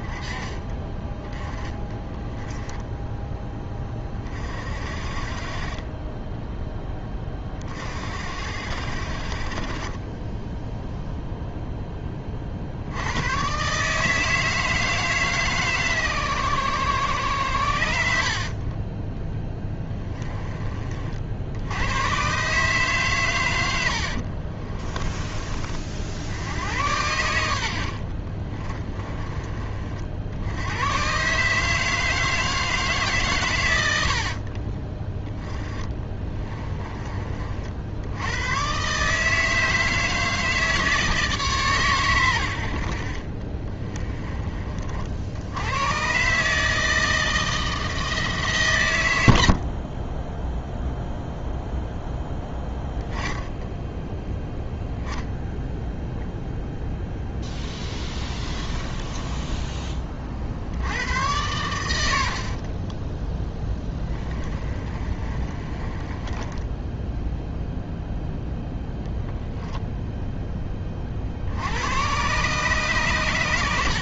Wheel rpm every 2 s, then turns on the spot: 20, 10, 40, 10, 60, 0, 60, 160, 120, 20, 30, 140, 30, 90, 20, 110, 150, 20, 20, 130, 160, 60, 30, 160, 110, 0, 10, 0, 0, 20, 80, 30, 30, 10, 10, 30, 130.
18-20 24-26 28-30 58-60 62-68